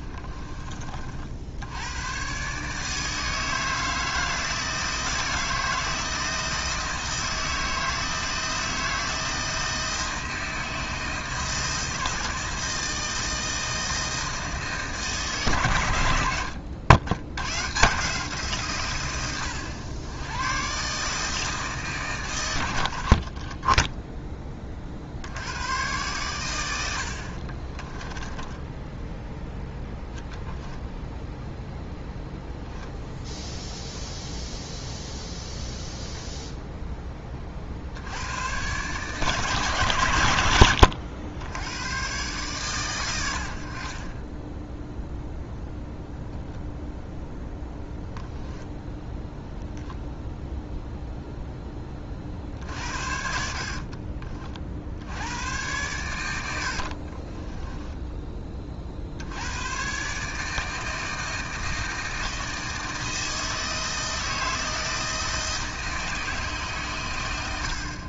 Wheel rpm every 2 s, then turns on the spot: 40, 150, 160, 160, 160, 160, 160, 160, 80, 140, 130, 80, 40, 90, 10, 0, 0, 0, 10, 130, 100, 120, 0, 0, 10, 0, 60, 60, 60, 40, 160, 160, 160, 140.
28-30 52-54 56-58